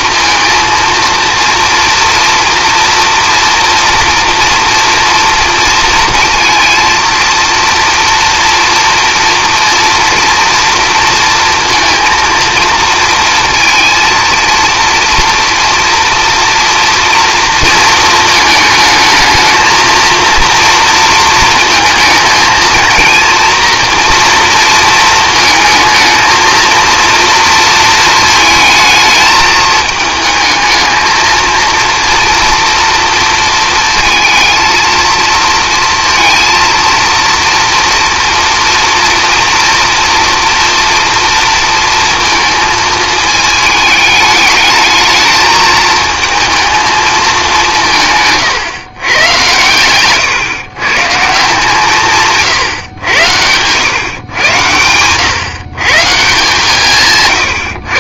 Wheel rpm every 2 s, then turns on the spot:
230, 230, 240, 230, 230, 230, 230, 230, 230, 220, 230, 230, 230, 230, 220, 220, 230, 230, 230, 240, 230, 220, 210, 220, 130, 140, 120, 110, 150.
none